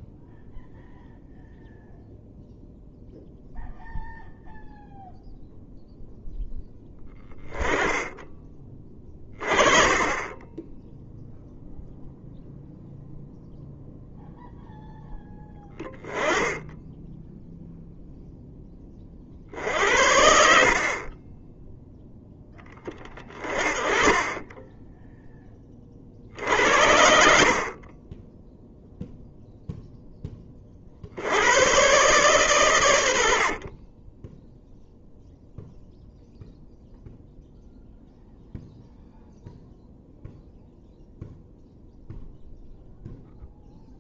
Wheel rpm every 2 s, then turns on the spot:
0, 0, 0, 10, 20, 0, 0, 0, 10, 30, 50, 20, 10, 70, 0, 60, 100, 0, 0, 0, 0, 0.
none